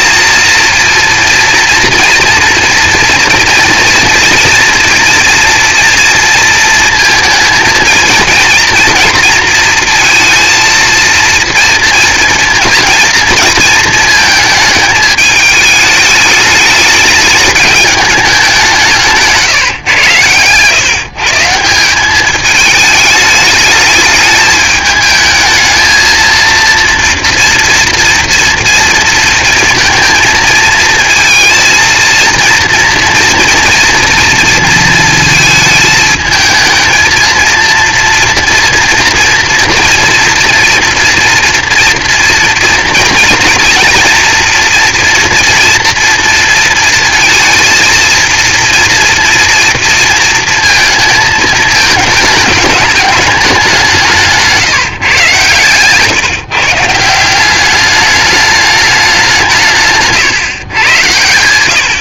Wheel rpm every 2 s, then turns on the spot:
230, 230, 230, 230, 230, 230, 230, 220, 210, 200, 130, 210, 210, 230, 230, 220, 230, 230, 220, 230, 230, 230, 240, 230, 230, 230, 210, 160, 150, 210, 130.
none